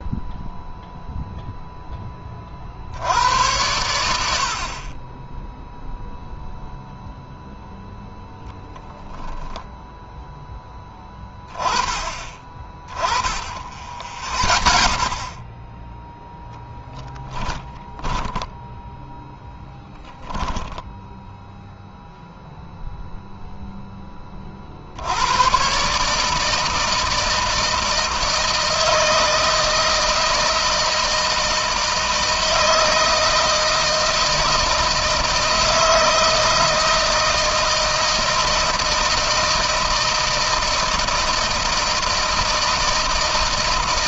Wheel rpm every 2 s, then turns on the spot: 0, 80, 30, 0, 10, 10, 20, 30, 0, 0, 0, 0, 80, 160, 160, 160, 160, 160, 160, 160, 160, 160.
none